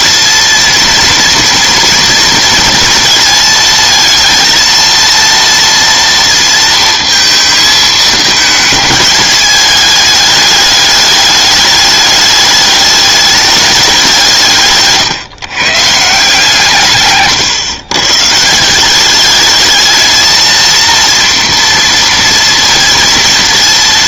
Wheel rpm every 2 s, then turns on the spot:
230, 230, 230, 230, 210, 210, 210, 140, 150, 170, 230, 230.
none